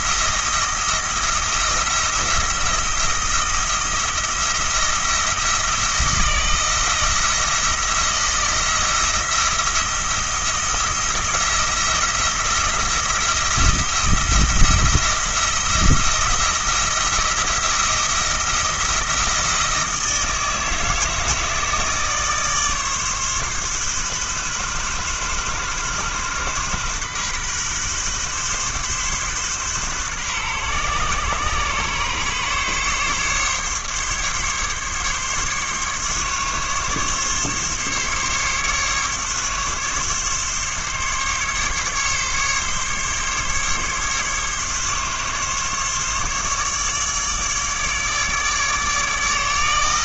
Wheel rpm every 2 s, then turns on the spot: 170, 170, 170, 160, 170, 170, 170, 170, 170, 170, 160, 140, 130, 130, 130, 130, 140, 140, 140, 140, 140, 140, 140, 150, 150.
none